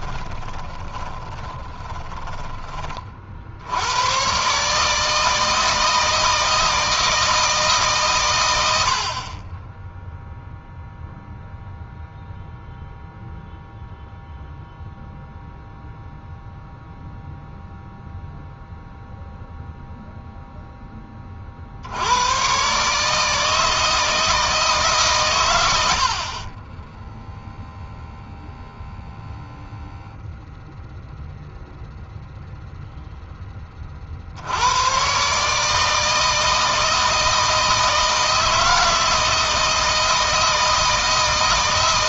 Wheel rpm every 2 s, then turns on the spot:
20, 30, 150, 160, 70, 0, 0, 0, 0, 0, 10, 140, 150, 30, 0, 0, 0, 90, 160, 160, 160.
0-2 26-28